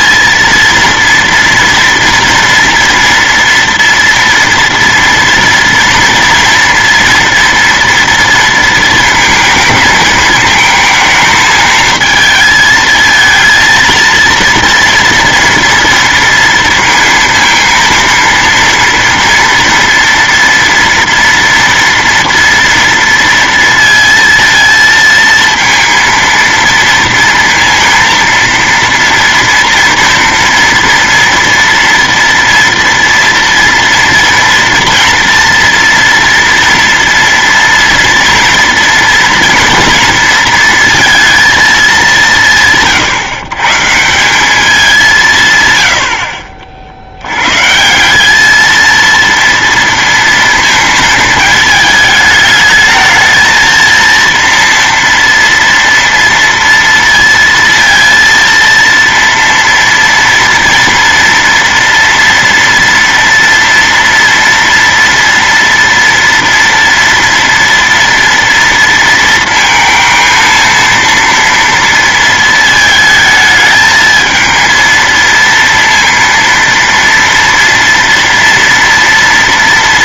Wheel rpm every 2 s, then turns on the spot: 230, 230, 230, 230, 230, 220, 220, 230, 230, 230, 230, 230, 230, 230, 230, 230, 230, 230, 230, 230, 230, 180, 180, 60, 200, 230, 210, 230, 230, 230, 230, 230, 230, 230, 230, 230, 230, 220, 230, 230.
none